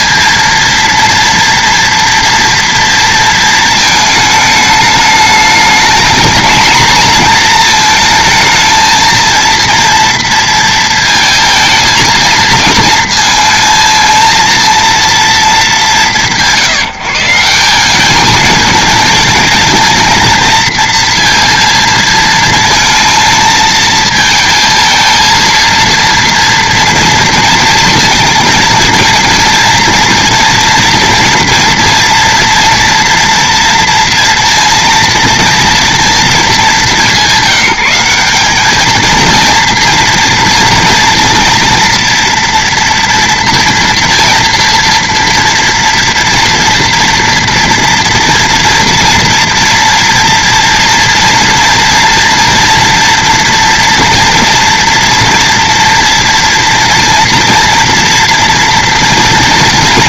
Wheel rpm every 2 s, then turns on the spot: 230, 230, 210, 230, 230, 230, 230, 230, 160, 220, 230, 230, 220, 230, 230, 230, 230, 230, 210, 210, 230, 230, 240, 230, 230, 230, 230, 240, 230, 240.
none